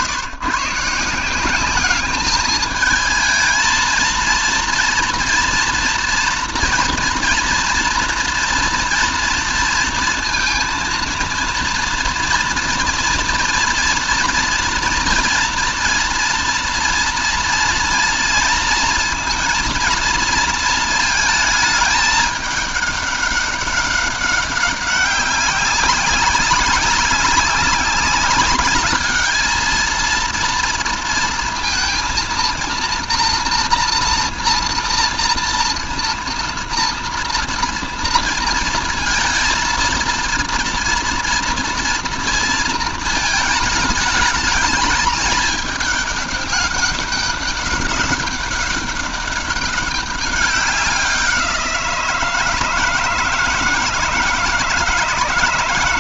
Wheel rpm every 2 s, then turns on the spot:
140, 220, 230, 230, 230, 230, 230, 230, 230, 230, 230, 210, 200, 200, 200, 230, 230, 230, 230, 220, 230, 230, 210, 200, 200, 190, 160, 170.
none